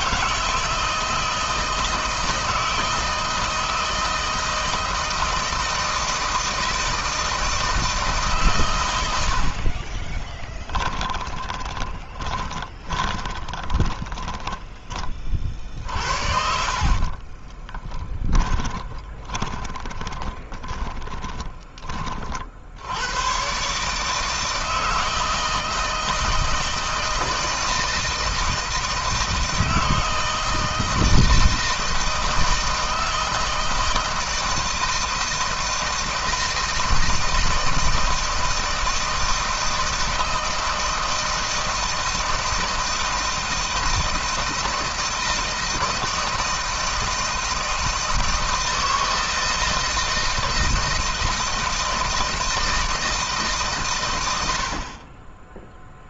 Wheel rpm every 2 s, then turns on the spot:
160, 160, 160, 160, 100, 10, 20, 30, 40, 20, 20, 90, 160, 160, 160, 160, 160, 160, 160, 160, 160, 160, 160, 160, 160, 160, 160, 40.
10-14 16-22